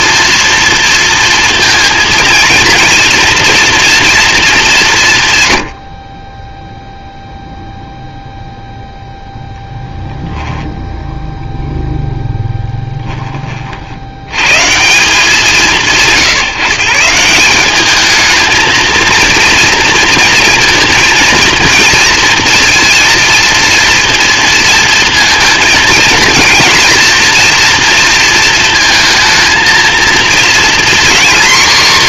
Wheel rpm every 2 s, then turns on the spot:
230, 230, 210, 10, 0, 0, 10, 130, 150, 220, 230, 230, 230, 230, 230, 240.
none